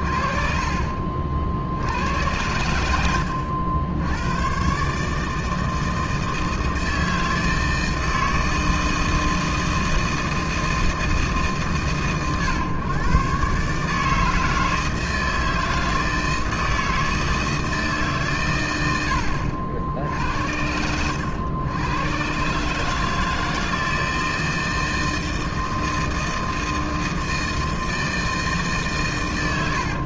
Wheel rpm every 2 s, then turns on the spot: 20, 90, 110, 160, 160, 160, 120, 160, 160, 120, 80, 130, 160, 160, 160.
none